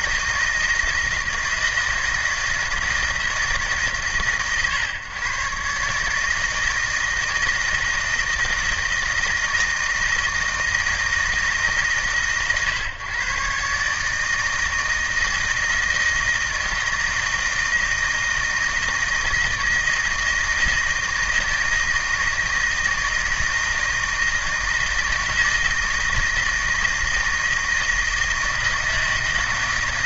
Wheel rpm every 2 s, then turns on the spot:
160, 160, 130, 160, 160, 160, 130, 160, 160, 160, 160, 160, 160, 160, 160.
none